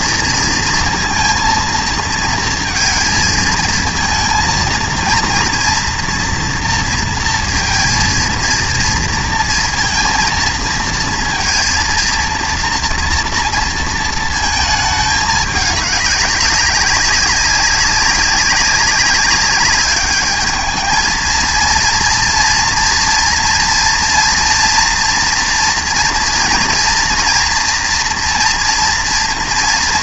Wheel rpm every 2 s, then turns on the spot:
230, 230, 230, 230, 230, 230, 230, 220, 190, 190, 220, 230, 230, 240, 230.
none